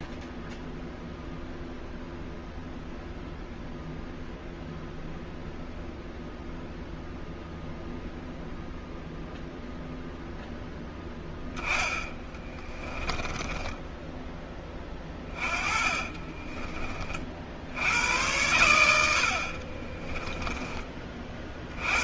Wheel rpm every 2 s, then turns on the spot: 0, 0, 0, 0, 0, 10, 20, 20, 30, 90, 20.
12-14 18-22